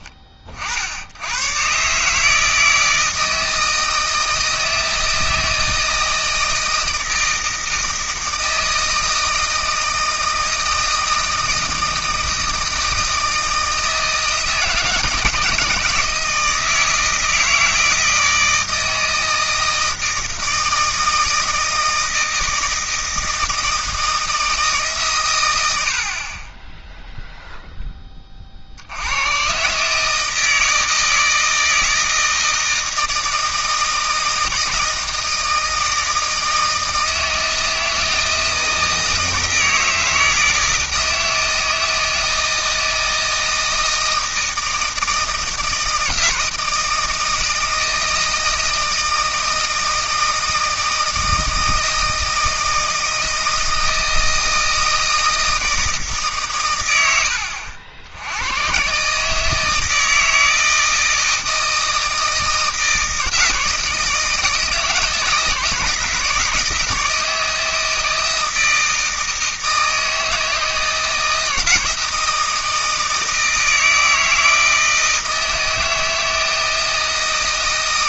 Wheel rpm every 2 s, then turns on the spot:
50, 160, 160, 160, 160, 160, 160, 160, 160, 160, 160, 160, 160, 20, 60, 160, 160, 160, 160, 160, 160, 160, 160, 160, 160, 160, 160, 160, 120, 110, 160, 160, 160, 160, 160, 160, 160, 160, 160.
none